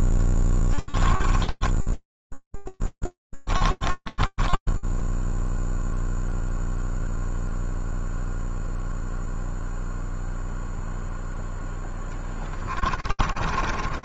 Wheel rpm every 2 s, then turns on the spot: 10, 10, 20, 0, 0, 0, 20.
0-6 12-14